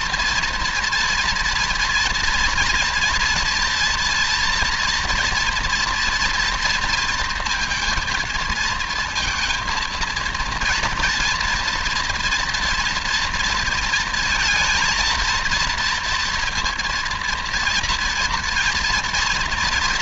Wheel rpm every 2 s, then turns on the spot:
230, 230, 240, 230, 230, 230, 230, 230, 230, 230.
none